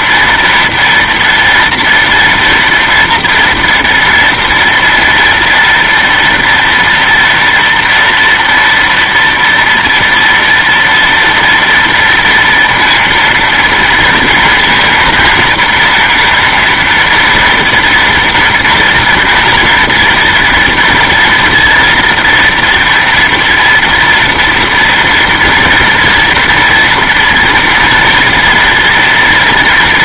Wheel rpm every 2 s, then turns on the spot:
230, 230, 240, 230, 230, 230, 230, 230, 230, 240, 240, 230, 230, 230, 230.
none